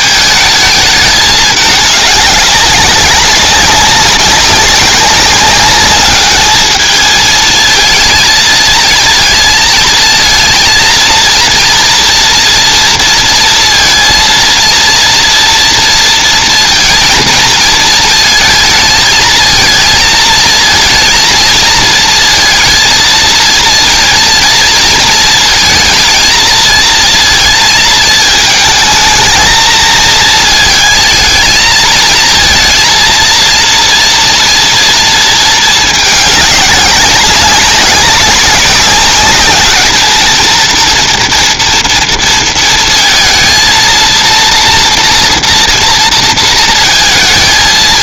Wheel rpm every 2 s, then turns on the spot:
220, 200, 200, 210, 220, 230, 230, 230, 230, 220, 220, 230, 230, 220, 220, 220, 230, 230, 200, 200, 220, 230, 230, 230.
none